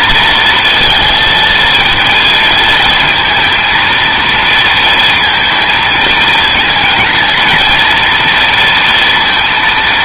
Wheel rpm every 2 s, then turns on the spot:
230, 220, 230, 220, 230.
none